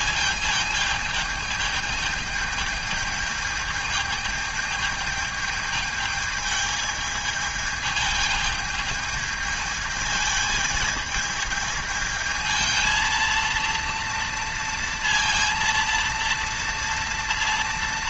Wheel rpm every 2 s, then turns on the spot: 220, 220, 220, 220, 220, 220, 220, 230, 230.
none